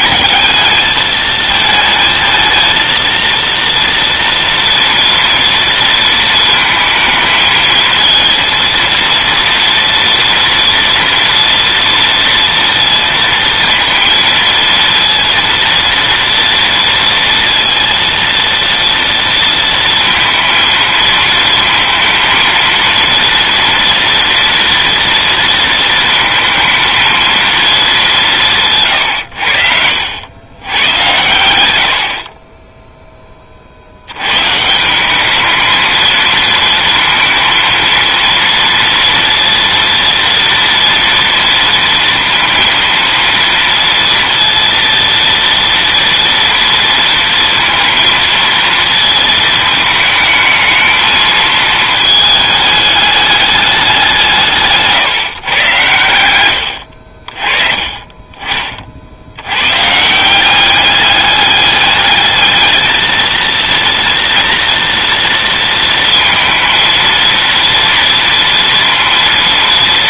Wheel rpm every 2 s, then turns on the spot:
220, 220, 230, 230, 230, 230, 230, 230, 230, 230, 230, 230, 230, 230, 150, 120, 20, 160, 220, 230, 240, 230, 230, 230, 230, 220, 210, 150, 90, 40, 190, 220, 230, 230, 230.
56-58